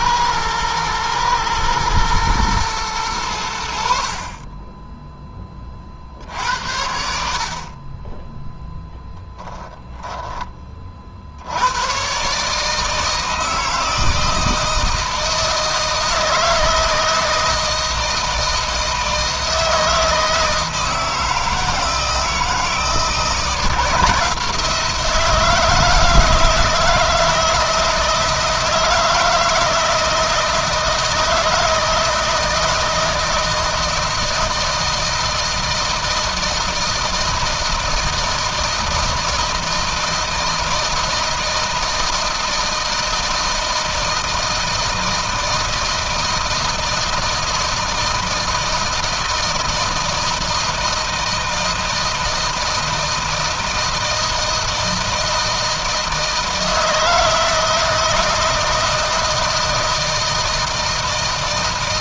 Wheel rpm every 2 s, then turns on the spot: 110, 110, 20, 60, 0, 30, 150, 160, 160, 160, 160, 160, 170, 160, 160, 160, 160, 160, 160, 160, 160, 160, 160, 160, 160, 170, 160, 160, 160, 160, 160.
none